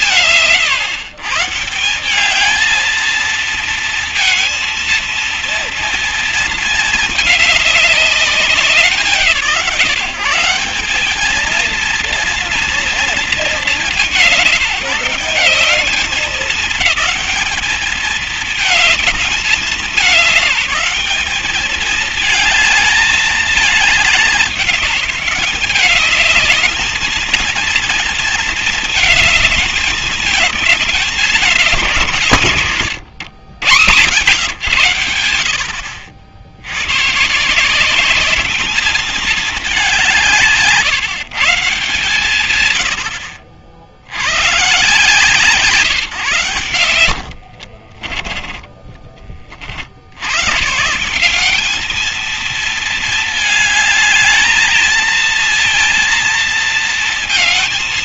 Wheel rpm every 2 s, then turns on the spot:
130, 220, 230, 220, 140, 200, 210, 190, 210, 220, 210, 210, 200, 220, 220, 210, 120, 90, 100, 220, 170, 80, 140, 100, 20, 150, 220, 220, 230.
46-50